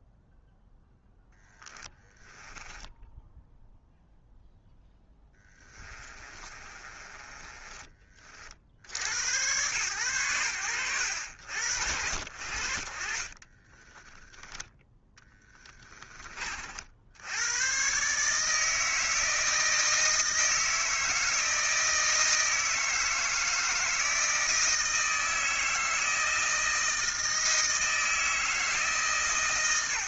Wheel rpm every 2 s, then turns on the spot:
0, 10, 10, 30, 70, 80, 40, 10, 70, 160, 160, 160, 160, 160, 150.
2-8 12-14